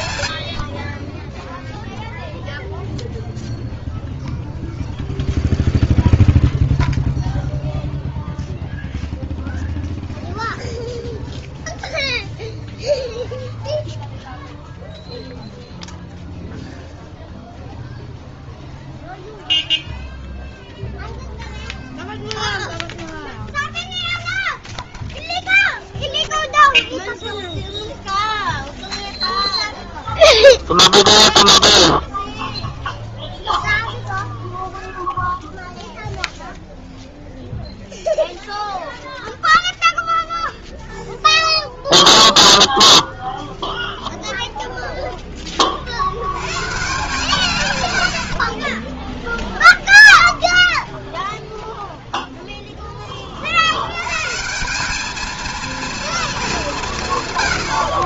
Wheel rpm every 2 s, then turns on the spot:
0, 0, 0, 0, 0, 0, 0, 0, 0, 0, 0, 0, 0, 0, 0, 0, 0, 0, 0, 0, 0, 0, 60, 30, 0, 0, 80, 230, 70.
46-48